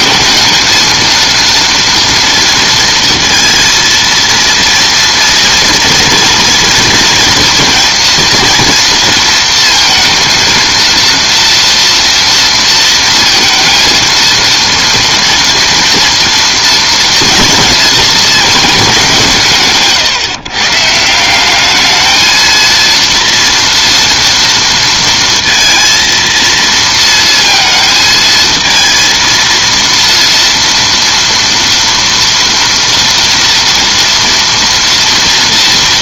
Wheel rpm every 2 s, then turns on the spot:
230, 230, 230, 230, 230, 230, 230, 230, 240, 210, 150, 230, 230, 230, 230, 230, 230, 230.
none